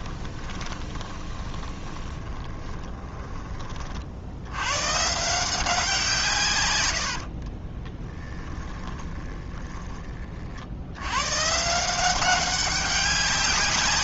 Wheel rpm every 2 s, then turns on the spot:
20, 10, 120, 110, 20, 80, 200.
0-4 8-10